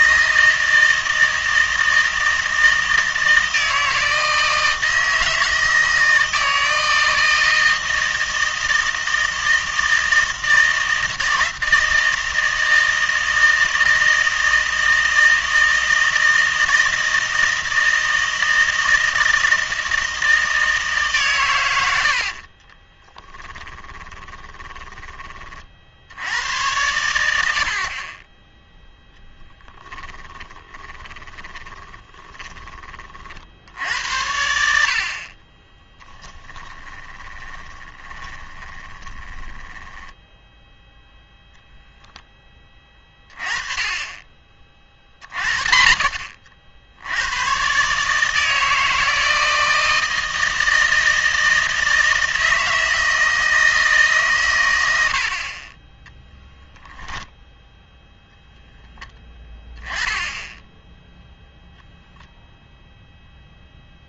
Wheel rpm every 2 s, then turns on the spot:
160, 160, 160, 160, 160, 160, 160, 160, 160, 160, 160, 40, 20, 90, 10, 20, 30, 80, 20, 20, 10, 10, 30, 60, 160, 160, 160, 110, 10, 10, 10, 0.
22-26 30-32 36-40